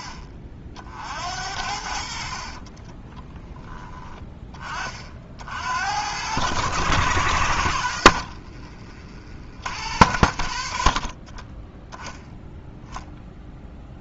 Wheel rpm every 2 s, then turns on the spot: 60, 30, 50, 100, 50, 30, 0.
2-4 8-10